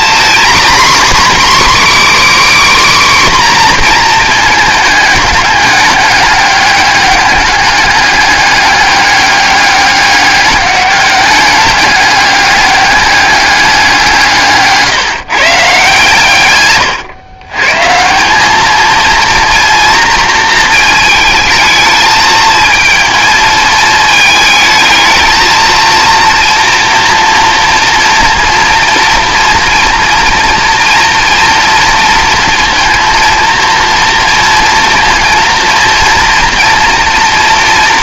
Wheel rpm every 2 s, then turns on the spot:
270, 290, 220, 210, 200, 200, 200, 150, 130, 210, 230, 230, 220, 240, 240, 240, 230, 230, 230.
14-16